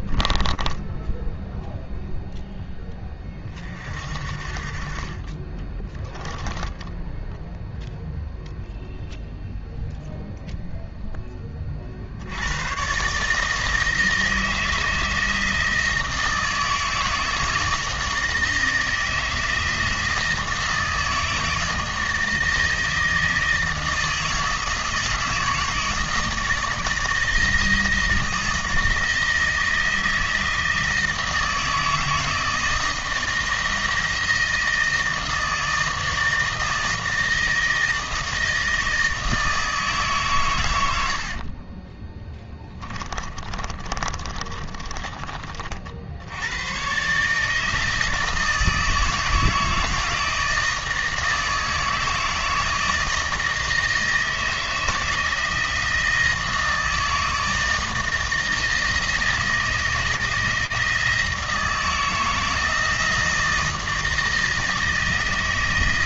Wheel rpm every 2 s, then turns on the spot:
10, 20, 40, 10, 0, 0, 120, 160, 160, 160, 160, 160, 160, 160, 160, 160, 160, 160, 160, 160, 90, 20, 20, 120, 160, 160, 160, 160, 160, 160, 160, 160, 160.
0-2 42-46